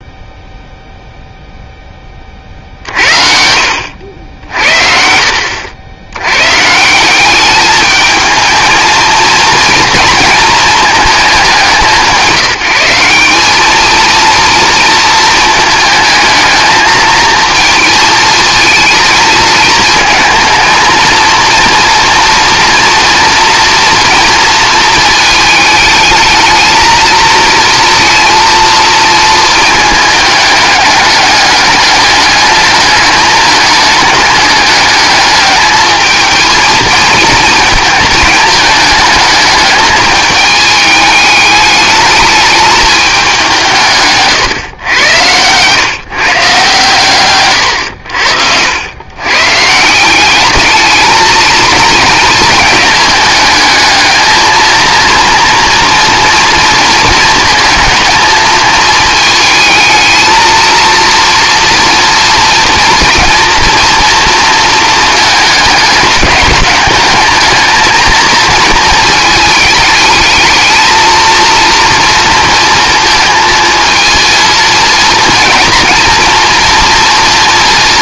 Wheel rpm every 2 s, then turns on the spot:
0, 60, 60, 160, 220, 220, 180, 230, 220, 230, 230, 230, 230, 220, 230, 210, 210, 210, 220, 220, 210, 210, 120, 130, 90, 220, 220, 230, 230, 220, 230, 230, 230, 210, 220, 220, 230, 220, 230.
none